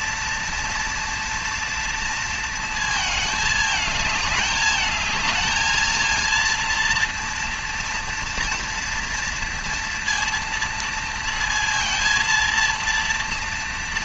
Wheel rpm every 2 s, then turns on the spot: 230, 230, 210, 230, 230, 230, 230.
none